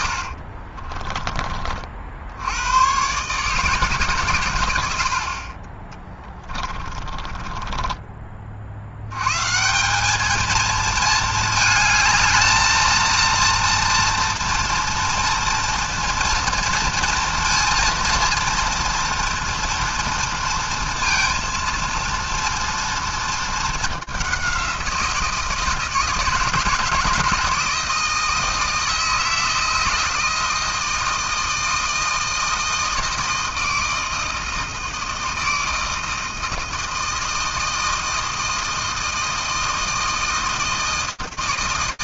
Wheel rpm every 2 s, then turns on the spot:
50, 90, 110, 20, 50, 220, 220, 230, 230, 230, 230, 230, 190, 160, 160, 160, 160, 160, 160, 160, 160.
0-2 6-8